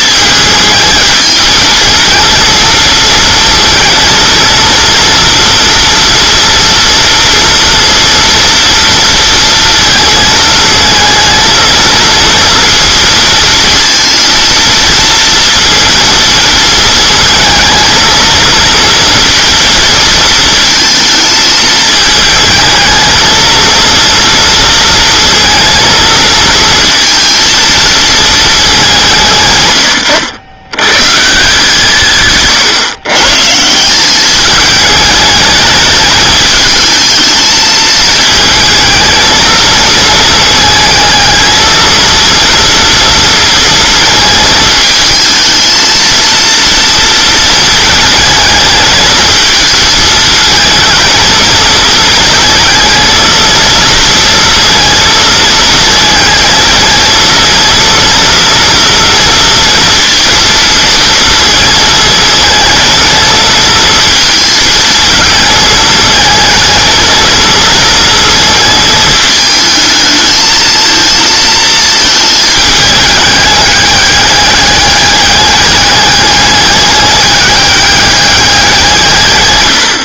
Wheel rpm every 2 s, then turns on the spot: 220, 230, 230, 230, 230, 220, 230, 230, 230, 230, 230, 220, 230, 230, 210, 110, 140, 210, 220, 220, 220, 230, 220, 230, 220, 220, 220, 230, 220, 230, 230, 230, 230, 230, 230, 220, 220, 200, 210, 180.
none